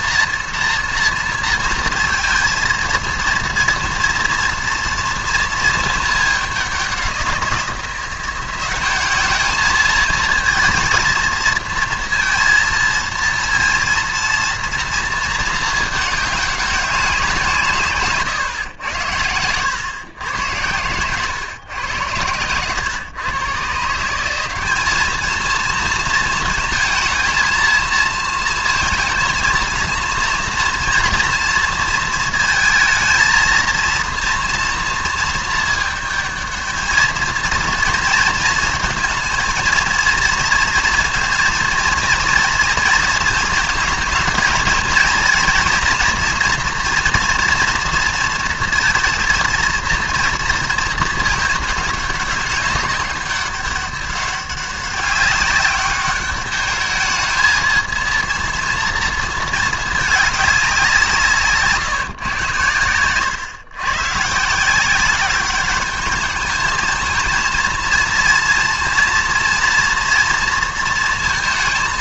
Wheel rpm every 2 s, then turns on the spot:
230, 230, 230, 200, 190, 220, 230, 230, 200, 110, 100, 100, 190, 230, 230, 230, 230, 230, 220, 230, 230, 230, 220, 230, 230, 220, 190, 200, 210, 230, 200, 100, 160, 210, 230, 230.
none